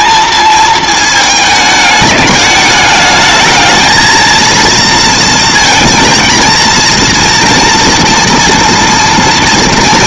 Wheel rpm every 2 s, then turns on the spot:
220, 210, 230, 230, 230.
none